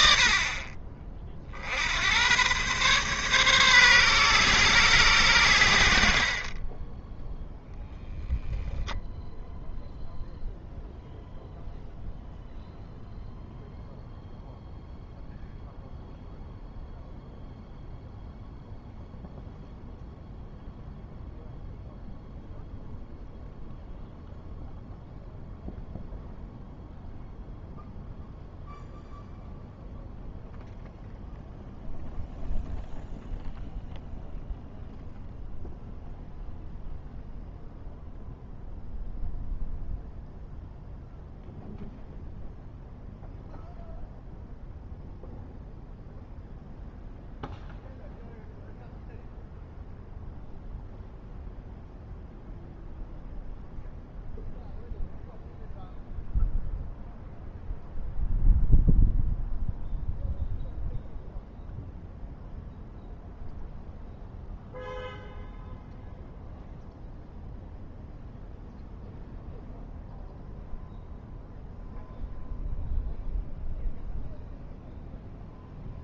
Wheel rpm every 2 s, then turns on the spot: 40, 130, 130, 20, 0, 0, 0, 0, 0, 0, 0, 0, 0, 0, 0, 0, 0, 0, 0, 0, 0, 0, 0, 0, 0, 0, 0, 0, 0, 0, 0, 0, 0, 0, 0, 0, 0, 0.
6-8